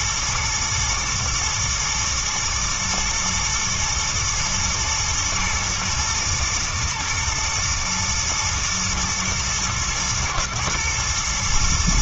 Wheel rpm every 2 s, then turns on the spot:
110, 110, 120, 110, 120, 110.
none